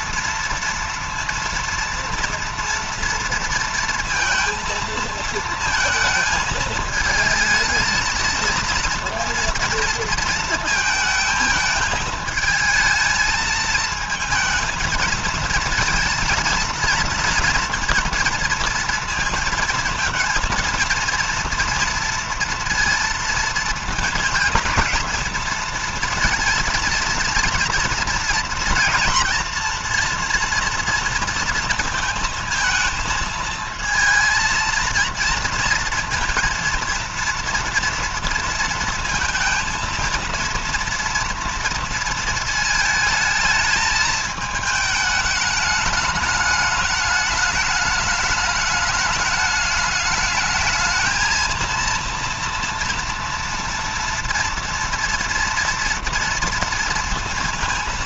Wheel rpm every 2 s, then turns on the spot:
230, 230, 220, 220, 230, 220, 220, 230, 230, 230, 230, 230, 230, 230, 230, 230, 230, 220, 230, 230, 230, 220, 220, 210, 210, 220, 230, 230, 230.
none